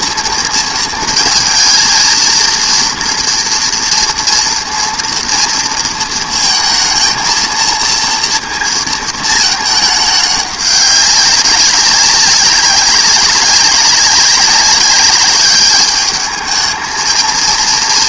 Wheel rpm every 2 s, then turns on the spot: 230, 230, 230, 230, 230, 200, 190, 190, 220.
none